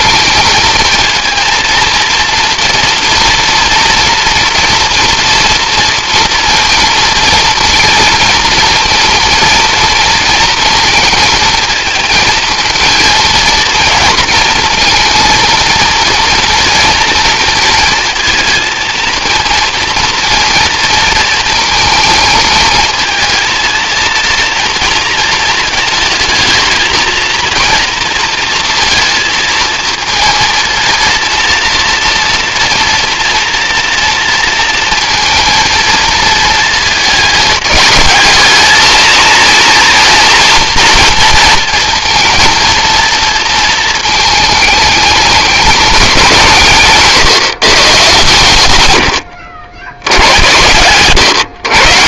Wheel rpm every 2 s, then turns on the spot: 220, 230, 230, 230, 230, 220, 230, 230, 230, 220, 230, 220, 230, 220, 230, 230, 230, 230, 220, 220, 230, 230, 210, 160, 100, 140.
none